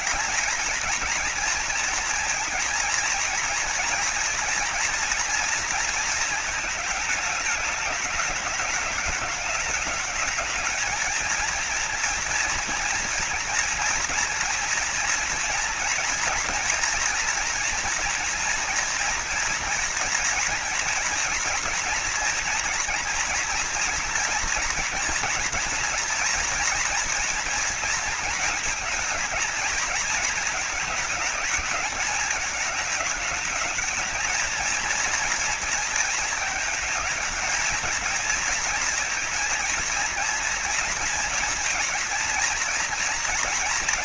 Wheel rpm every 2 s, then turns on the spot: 230, 230, 240, 220, 210, 220, 230, 230, 230, 230, 230, 230, 230, 230, 230, 220, 220, 230, 210, 230, 230, 230.
none